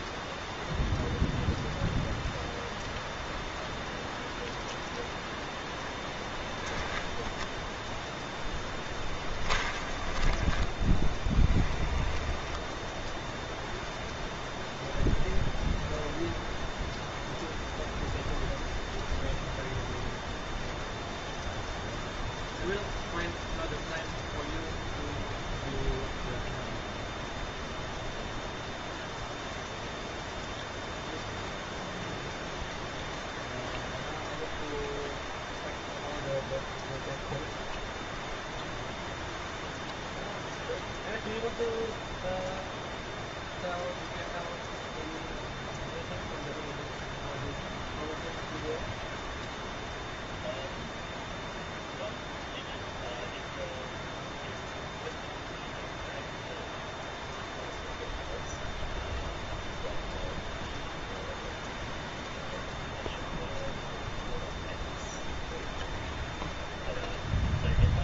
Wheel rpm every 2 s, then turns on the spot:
0, 0, 0, 0, 10, 20, 0, 0, 0, 0, 0, 0, 0, 0, 0, 0, 0, 0, 0, 0, 0, 0, 0, 0, 0, 0, 0, 0, 0, 0, 0, 0, 0, 0.
8-12